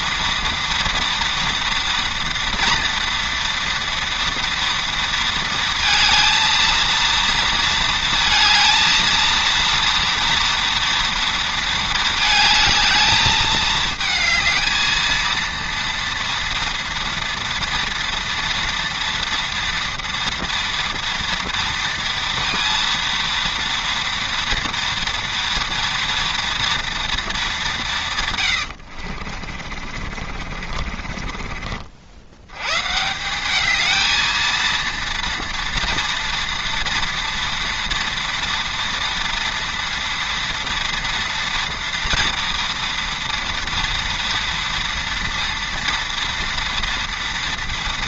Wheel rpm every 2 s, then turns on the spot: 230, 230, 230, 230, 230, 230, 220, 220, 230, 230, 230, 230, 230, 230, 100, 40, 100, 230, 230, 230, 230, 230, 230, 230.
28-32